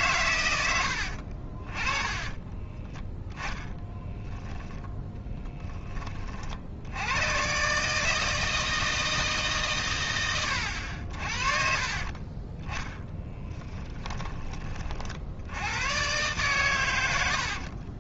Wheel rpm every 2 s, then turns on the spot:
80, 20, 0, 80, 160, 70, 10, 40, 110.
2-4 12-14